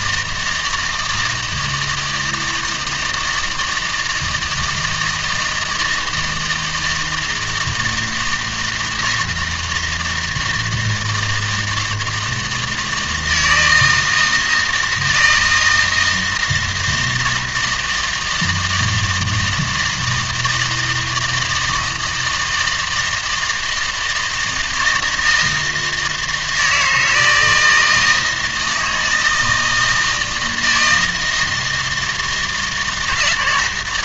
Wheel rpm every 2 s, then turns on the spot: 160, 160, 160, 160, 160, 160, 160, 160, 160, 160, 160, 160, 160, 160, 160, 160, 170.
none